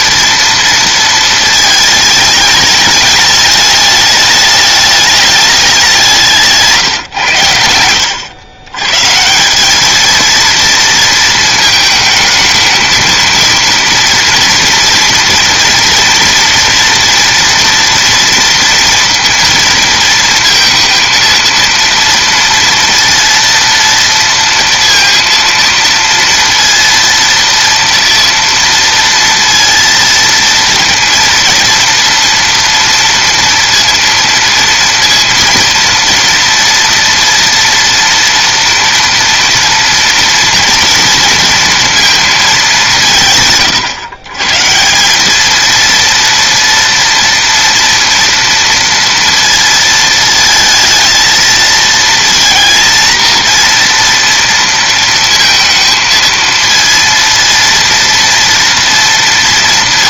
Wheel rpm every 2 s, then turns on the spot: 230, 210, 210, 150, 110, 230, 220, 230, 230, 230, 230, 230, 230, 230, 230, 230, 230, 230, 230, 230, 230, 200, 160, 230, 230, 220, 230, 230, 230, 230.
none